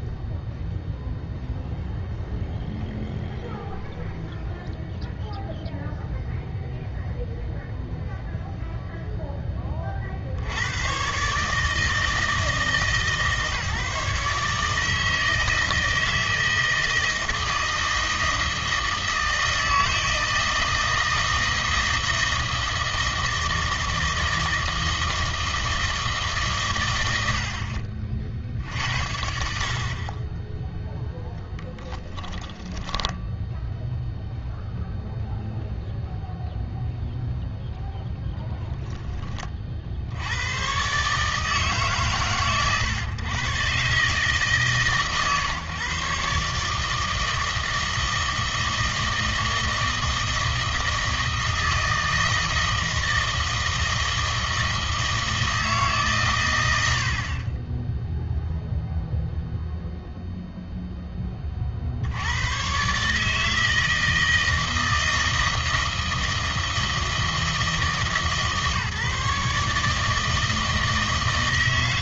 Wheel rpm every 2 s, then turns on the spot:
0, 0, 0, 0, 0, 110, 160, 150, 160, 160, 160, 160, 160, 130, 60, 10, 10, 0, 0, 0, 120, 120, 150, 150, 160, 160, 160, 160, 90, 0, 0, 120, 160, 160, 150, 160.
32-34